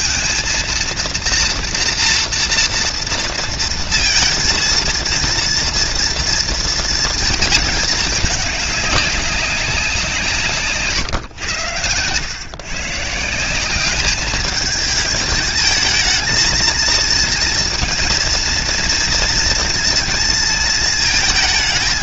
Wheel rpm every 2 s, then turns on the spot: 230, 230, 230, 230, 200, 140, 150, 220, 230, 240, 230.
none